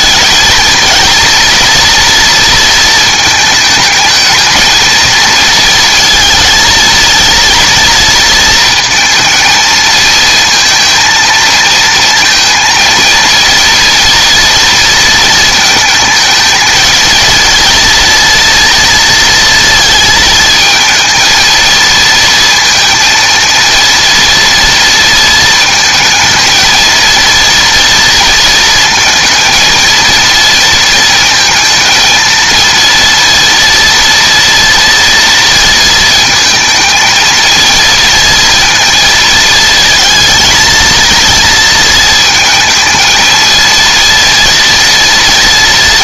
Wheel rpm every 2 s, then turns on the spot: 230, 230, 220, 230, 220, 230, 230, 230, 220, 230, 220, 230, 230, 230, 220, 230, 230, 230, 230, 230, 230, 220, 230.
none